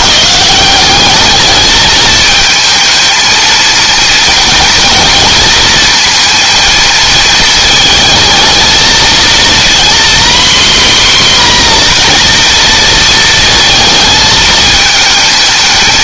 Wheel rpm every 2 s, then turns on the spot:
180, 220, 230, 230, 230, 260, 240, 220.
none